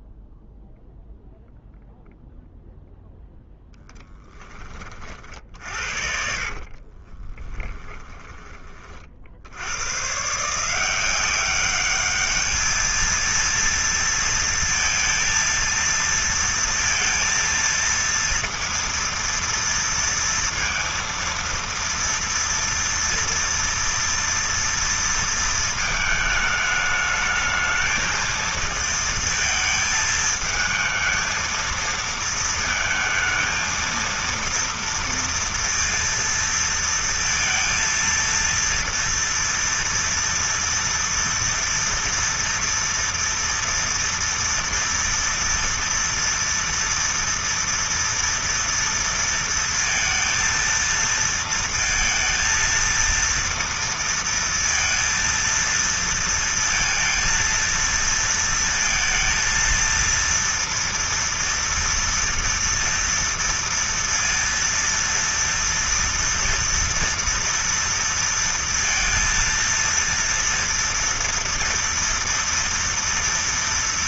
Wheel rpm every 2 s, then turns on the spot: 0, 0, 30, 40, 30, 170, 220, 230, 230, 230, 230, 230, 230, 210, 220, 220, 220, 230, 230, 230, 240, 230, 230, 230, 230, 230, 230, 230, 230, 230, 230, 230, 230, 230, 230, 230, 230.
6-8